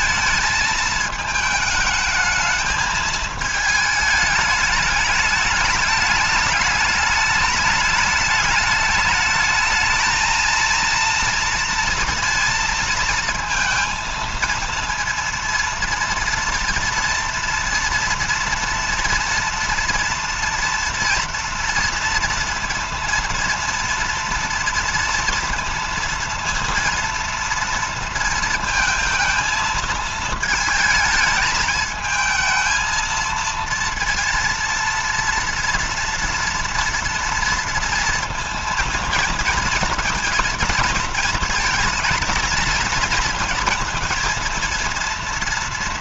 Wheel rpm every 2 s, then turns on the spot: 220, 220, 210, 210, 210, 230, 230, 230, 230, 230, 230, 230, 230, 230, 230, 220, 220, 230, 230, 230, 230, 230, 230.
none